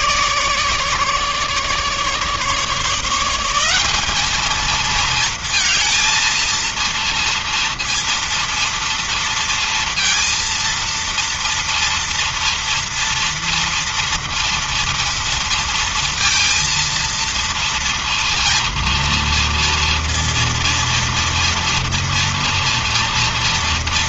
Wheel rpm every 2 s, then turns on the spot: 150, 150, 210, 230, 230, 230, 230, 230, 230, 230, 230, 230.
none